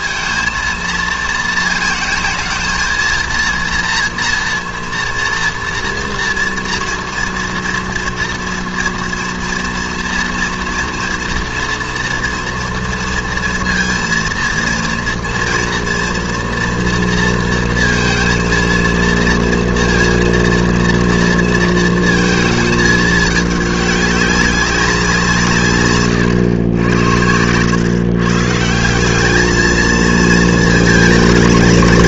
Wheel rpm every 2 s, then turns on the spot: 230, 230, 230, 240, 230, 230, 230, 230, 240, 230, 230, 220, 190, 100, 160, 220.
none